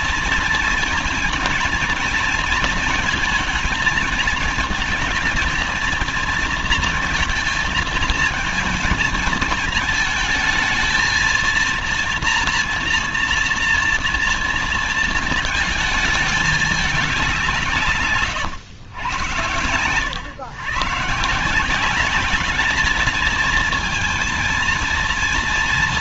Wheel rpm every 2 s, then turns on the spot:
230, 230, 220, 230, 220, 220, 230, 230, 210, 120, 120, 210, 230.
none